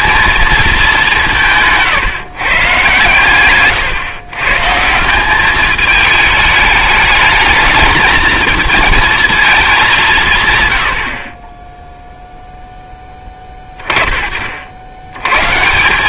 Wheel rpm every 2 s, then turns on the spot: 210, 140, 160, 210, 220, 110, 10, 60.
none